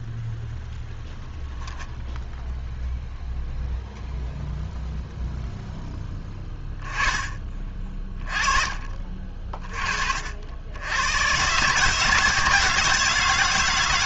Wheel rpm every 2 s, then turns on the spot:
0, 0, 0, 20, 30, 70, 160.
none